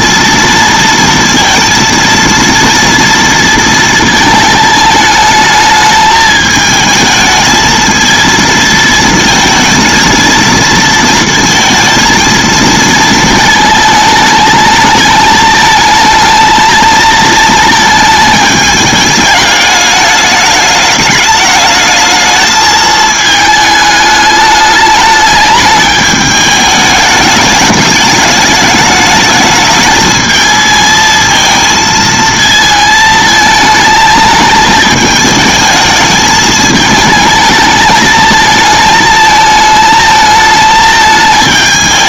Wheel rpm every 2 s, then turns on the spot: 230, 230, 220, 220, 230, 230, 230, 220, 220, 210, 210, 220, 210, 210, 210, 220, 220, 220, 220, 220, 220.
none